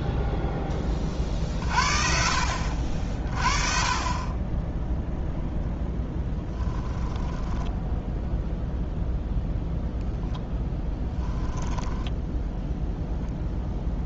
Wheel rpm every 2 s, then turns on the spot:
30, 50, 0, 10, 0, 10, 0.
6-8 10-12